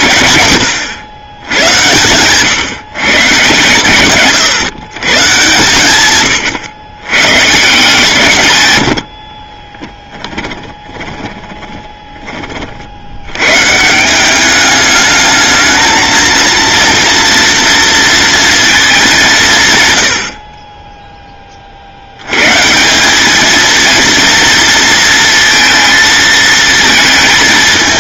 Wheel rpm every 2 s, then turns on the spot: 120, 130, 130, 100, 90, 20, 70, 210, 230, 220, 20, 170, 230, 220.
10-12